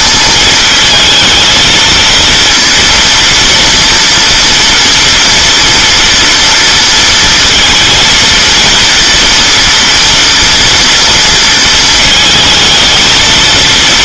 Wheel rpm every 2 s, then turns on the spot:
230, 230, 230, 230, 230, 230, 220.
none